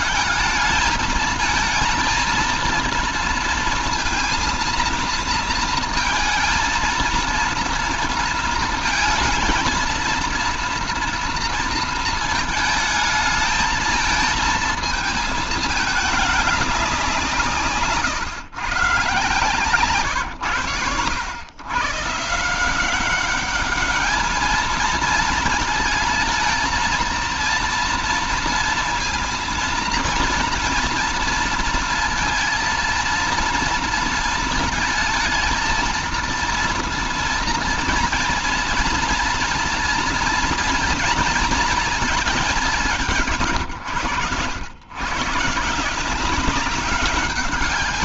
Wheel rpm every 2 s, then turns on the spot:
220, 230, 230, 230, 230, 240, 220, 220, 210, 130, 110, 160, 220, 230, 230, 230, 230, 230, 230, 230, 230, 210, 120, 190.
none